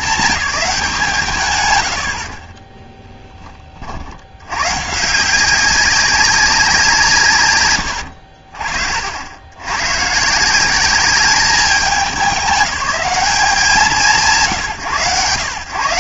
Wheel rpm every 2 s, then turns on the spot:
180, 30, 120, 180, 50, 180, 200, 140.
none